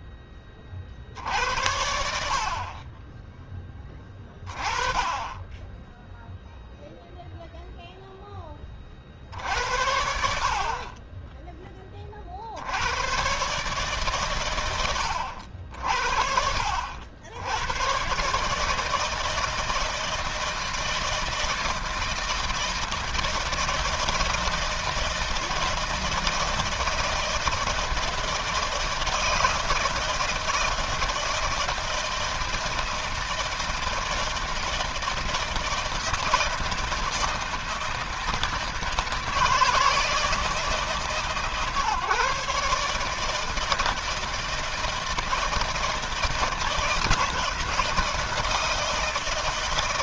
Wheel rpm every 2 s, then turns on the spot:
70, 20, 10, 10, 60, 40, 130, 60, 130, 160, 160, 160, 160, 160, 160, 160, 160, 160, 160, 160, 150, 160, 160, 160, 160.
none